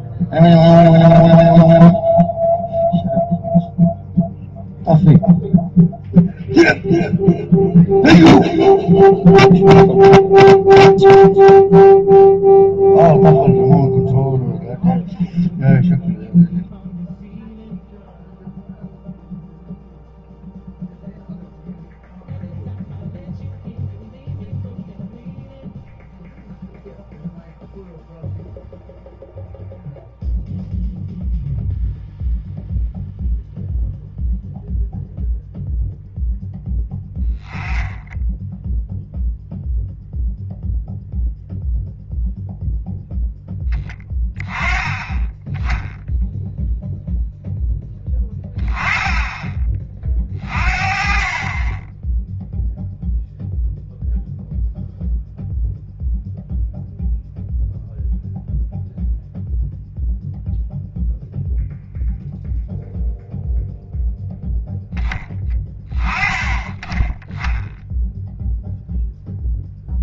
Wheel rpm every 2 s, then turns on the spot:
0, 0, 0, 0, 0, 0, 0, 0, 0, 0, 0, 0, 0, 0, 0, 0, 0, 0, 0, 0, 0, 0, 10, 0, 10, 40, 0, 0, 0, 0, 0, 0, 0, 10, 0.
none